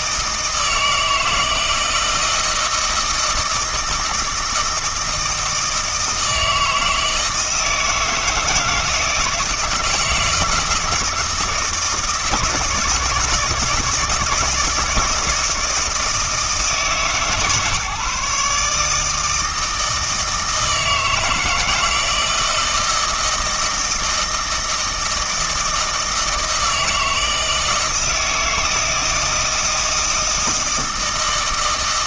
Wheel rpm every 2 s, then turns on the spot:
160, 160, 160, 160, 160, 160, 160, 160, 160, 150, 160, 160, 160, 160, 160, 160.
none